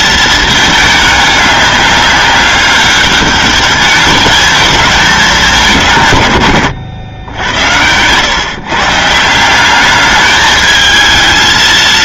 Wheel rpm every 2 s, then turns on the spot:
220, 200, 210, 140, 120, 210.
none